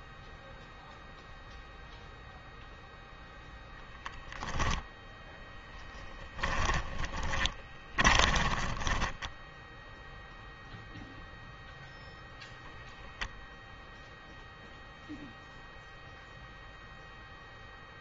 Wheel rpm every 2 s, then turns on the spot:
0, 0, 10, 20, 10, 0, 0, 0, 0.
4-10